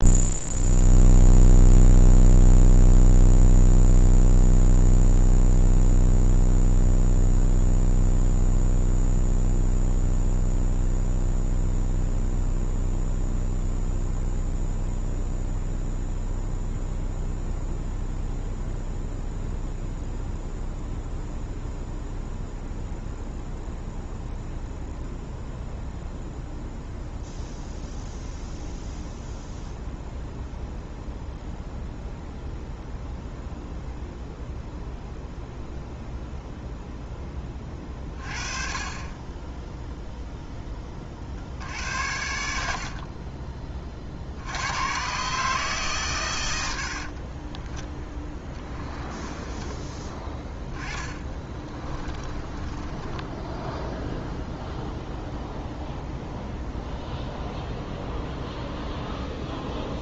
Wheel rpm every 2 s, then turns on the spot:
0, 0, 0, 0, 0, 0, 0, 0, 0, 0, 0, 0, 0, 0, 0, 0, 0, 0, 0, 30, 20, 70, 90, 80, 20, 10, 20, 0, 0, 0.
52-54